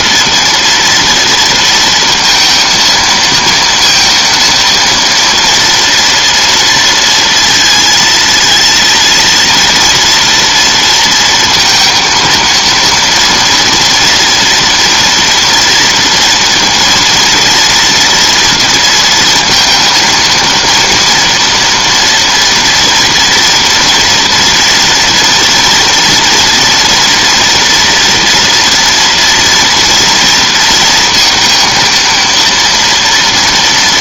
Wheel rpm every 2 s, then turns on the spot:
230, 230, 230, 230, 230, 230, 230, 230, 230, 230, 230, 230, 240, 230, 240, 230, 230.
none